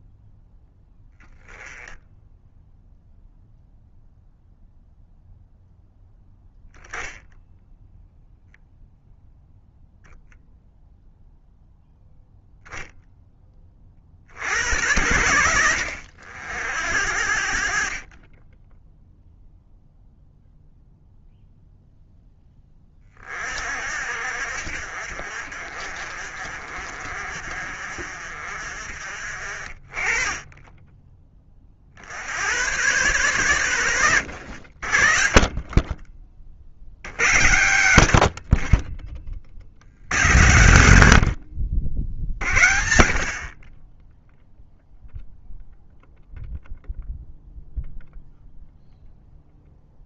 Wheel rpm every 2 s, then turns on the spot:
0, 0, 0, 10, 0, 0, 0, 80, 70, 20, 0, 10, 60, 40, 50, 20, 100, 60, 50, 40, 90, 60, 0, 0, 0.
none